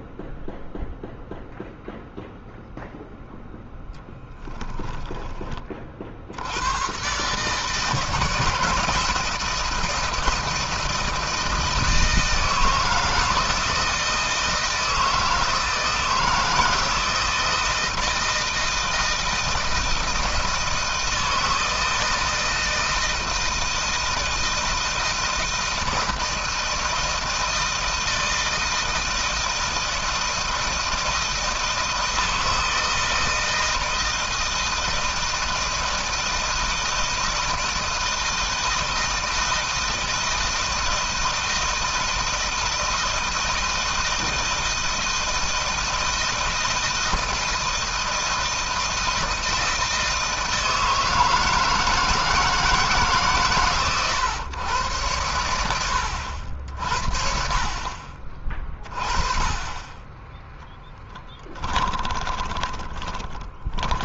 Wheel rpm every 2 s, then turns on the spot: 0, 0, 20, 120, 160, 160, 160, 160, 160, 160, 160, 170, 160, 160, 160, 160, 160, 160, 160, 160, 160, 160, 160, 160, 160, 160, 150, 100, 60, 30, 10, 20.
60-64